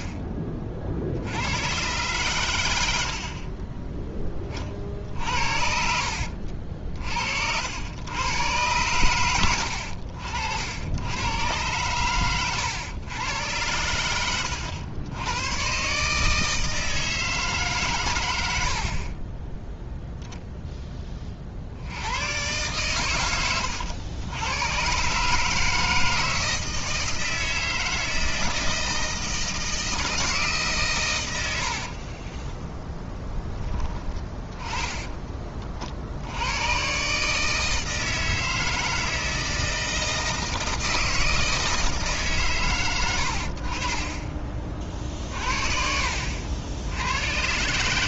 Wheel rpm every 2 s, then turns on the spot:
50, 90, 40, 60, 110, 80, 110, 90, 160, 70, 10, 120, 110, 160, 160, 150, 10, 20, 120, 160, 160, 130, 40, 90.
18-20 32-36